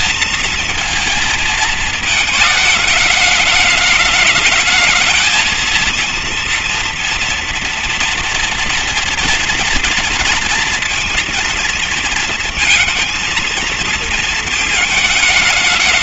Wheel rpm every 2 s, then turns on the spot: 230, 210, 220, 230, 230, 230, 230, 220.
none